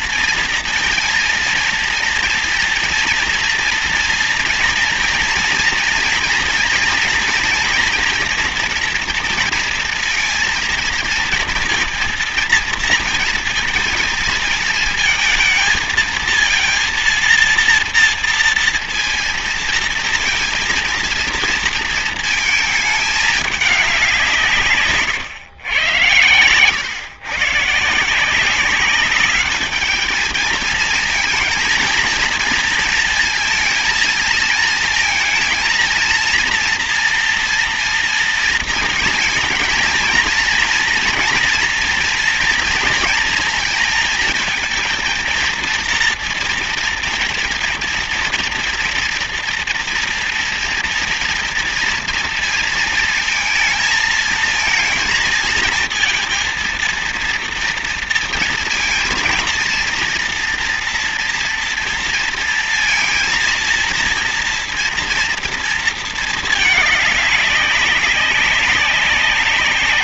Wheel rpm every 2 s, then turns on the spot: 230, 230, 230, 240, 240, 230, 230, 220, 230, 230, 230, 220, 150, 120, 190, 220, 230, 230, 230, 230, 230, 230, 220, 230, 230, 230, 230, 220, 230, 230, 230, 230, 230, 220, 190.
24-26